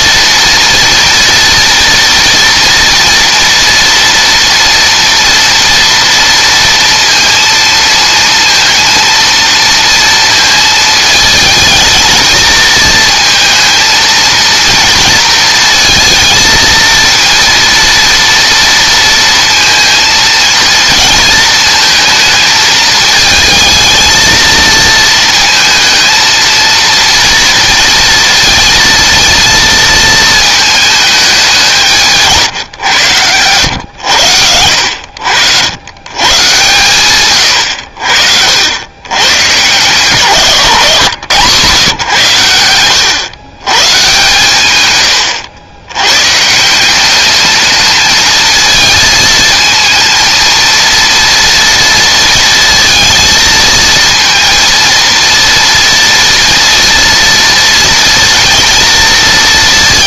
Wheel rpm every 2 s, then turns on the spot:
230, 230, 230, 230, 230, 220, 220, 230, 230, 230, 220, 220, 230, 230, 220, 210, 110, 70, 130, 110, 120, 100, 110, 200, 220, 230, 230, 230, 230, 230.
none